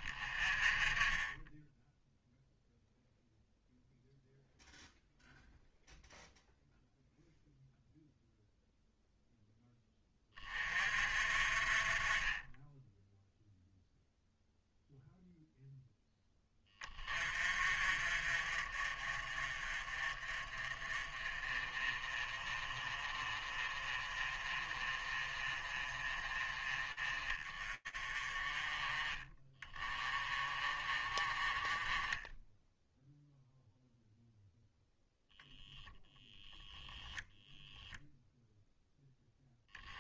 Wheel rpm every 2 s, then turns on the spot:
0, 0, 0, 0, 20, 30, 0, 10, 40, 30, 30, 30, 30, 20, 30, 10, 0, 0, 0, 10.
none